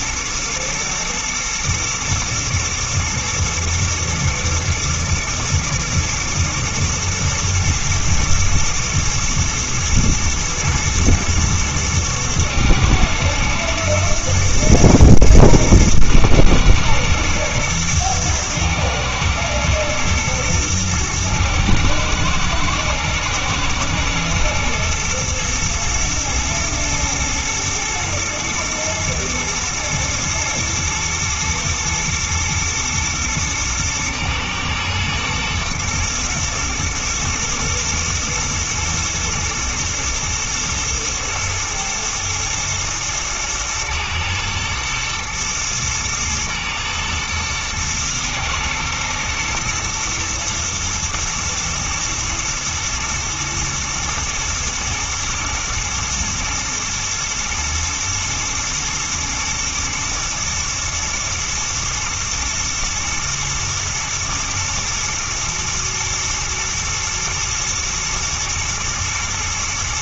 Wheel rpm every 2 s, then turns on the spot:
120, 120, 120, 120, 120, 120, 110, 120, 110, 120, 110, 110, 110, 110, 110, 110, 110, 110, 120, 120, 110, 110, 110, 110, 110, 120, 110, 120, 120, 120, 110, 120, 120, 110, 110.
none